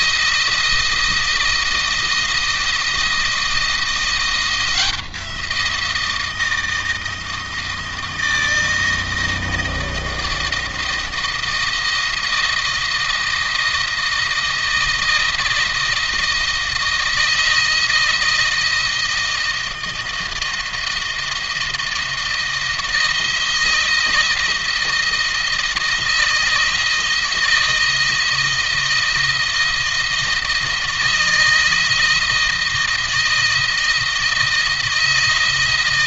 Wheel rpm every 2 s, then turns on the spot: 170, 170, 170, 160, 160, 160, 160, 160, 160, 160, 160, 160, 160, 160, 160, 160, 160, 170.
none